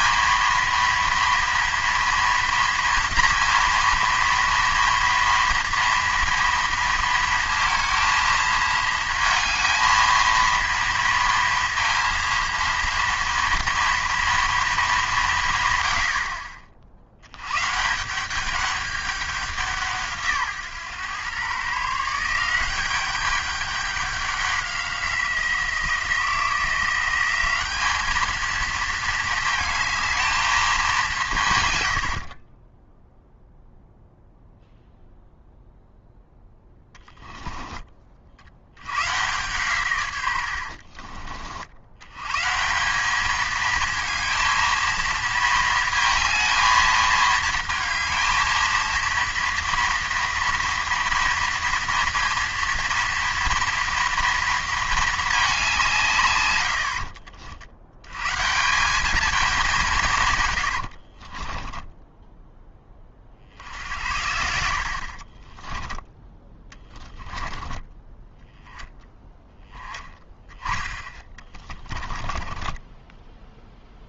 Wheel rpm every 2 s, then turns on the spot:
230, 230, 230, 230, 220, 230, 230, 230, 60, 200, 130, 190, 190, 170, 220, 210, 20, 0, 10, 90, 70, 160, 220, 220, 220, 230, 230, 230, 80, 170, 90, 10, 70, 20, 10, 20, 20.
36-38 40-42 60-62 66-68 72-74